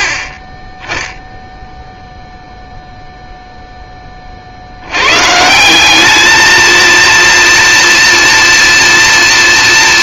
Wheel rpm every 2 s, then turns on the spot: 10, 0, 120, 230, 230.
none